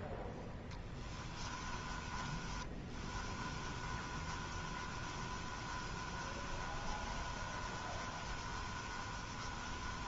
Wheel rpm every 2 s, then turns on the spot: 20, 20, 20, 20, 20.
0-10